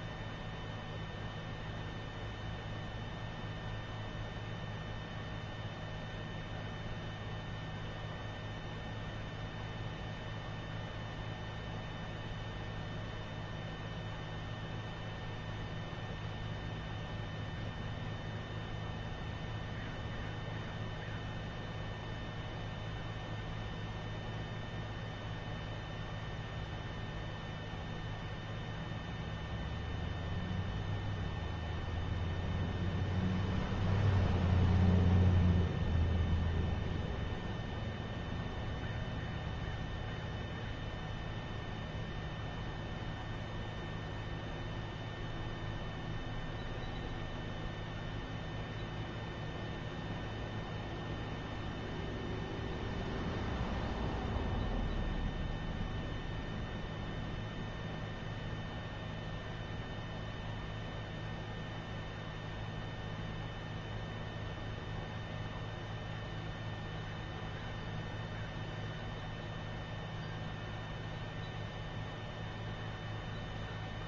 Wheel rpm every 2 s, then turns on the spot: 0, 0, 0, 0, 0, 0, 0, 0, 0, 0, 0, 0, 0, 0, 0, 0, 0, 0, 0, 0, 0, 0, 0, 0, 0, 0, 0, 0, 0, 0, 0, 0, 0, 0, 0, 0, 0.
none